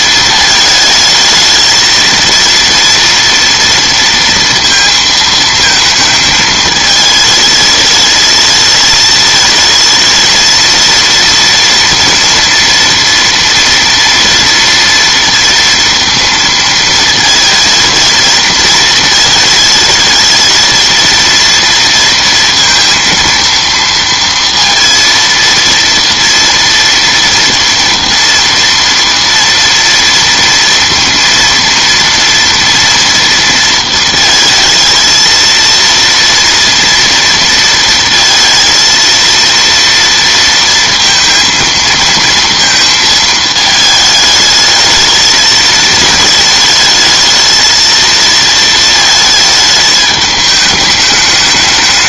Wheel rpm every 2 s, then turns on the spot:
220, 230, 230, 220, 220, 230, 230, 230, 230, 220, 230, 230, 230, 230, 230, 230, 230, 220, 230, 230, 230, 230, 220, 220, 220, 210.
none